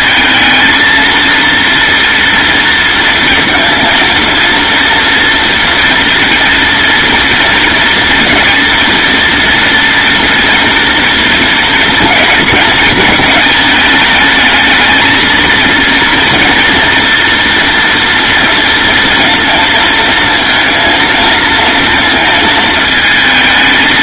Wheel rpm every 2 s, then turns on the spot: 230, 230, 240, 230, 230, 230, 240, 220, 230, 230, 230, 220.
none